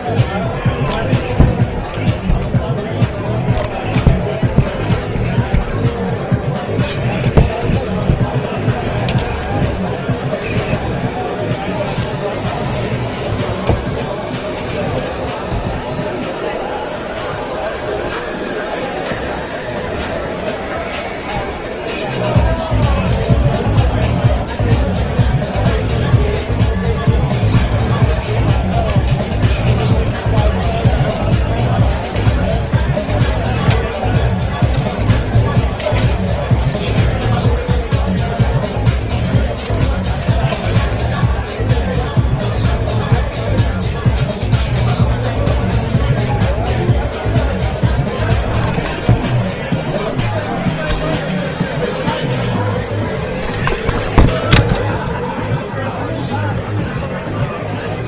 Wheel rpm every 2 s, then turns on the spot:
0, 0, 0, 0, 0, 0, 0, 0, 0, 0, 0, 0, 0, 0, 0, 0, 0, 0, 0, 0, 0, 0, 0, 0, 0, 0, 0, 0, 0.
none